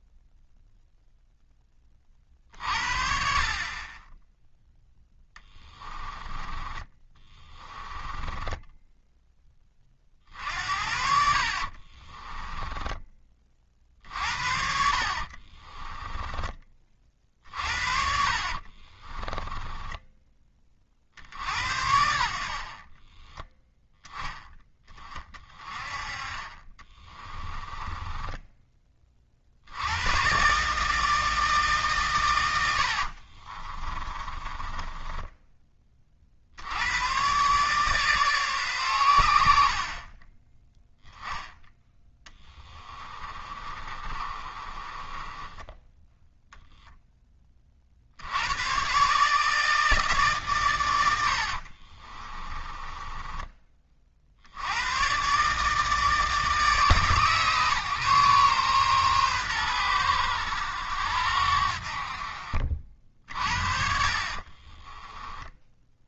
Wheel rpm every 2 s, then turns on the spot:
0, 50, 0, 20, 10, 60, 10, 60, 30, 30, 40, 40, 20, 30, 20, 150, 80, 20, 90, 120, 10, 30, 20, 0, 120, 110, 20, 100, 140, 130, 90, 40, 20.
6-10 12-14 18-20 26-28 32-36 42-46 52-54 64-66